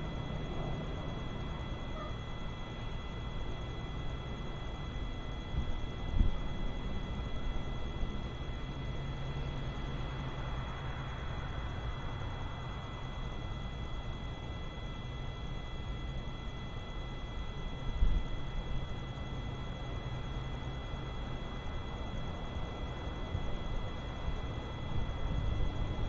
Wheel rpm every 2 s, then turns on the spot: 0, 0, 0, 0, 0, 0, 0, 0, 0, 0, 0, 0, 0.
none